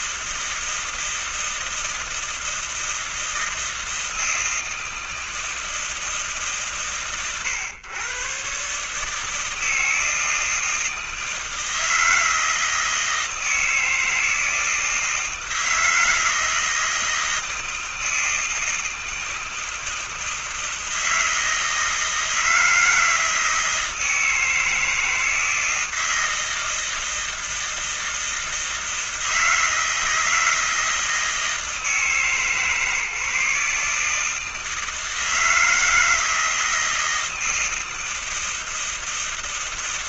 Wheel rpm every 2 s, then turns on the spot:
160, 160, 160, 140, 140, 160, 160, 160, 160, 160, 160, 160, 160, 160, 160, 160, 140, 160, 160, 160.
none